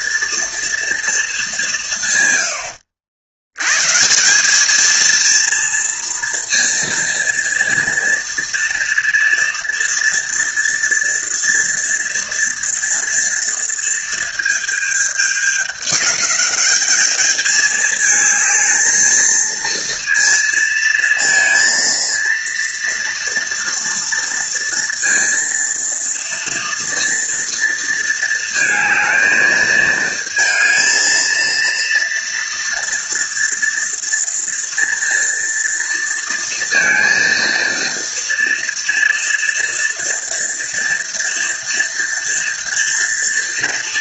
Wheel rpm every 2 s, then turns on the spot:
230, 80, 220, 230, 230, 230, 230, 220, 210, 220, 230, 230, 230, 230, 220, 230, 230, 230, 230, 230, 230, 230.
none